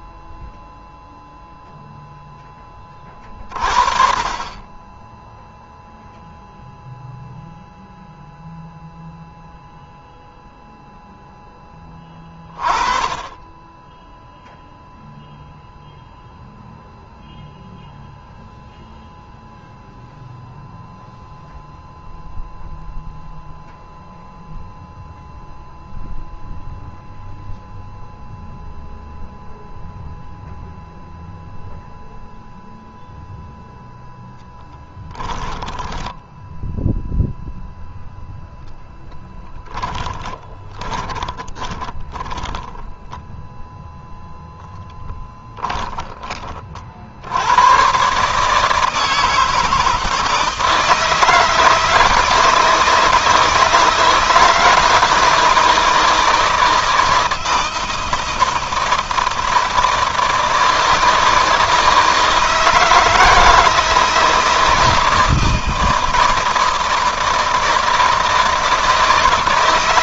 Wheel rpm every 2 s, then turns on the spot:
0, 30, 10, 0, 0, 0, 30, 0, 0, 0, 0, 0, 0, 0, 0, 0, 0, 10, 0, 10, 20, 10, 10, 50, 160, 160, 160, 160, 160, 160, 160, 160, 160, 160, 160.
34-36 38-44